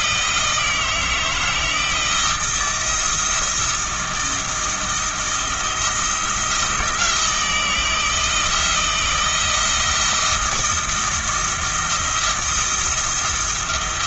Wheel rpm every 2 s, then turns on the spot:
160, 160, 160, 170, 160, 160, 170.
none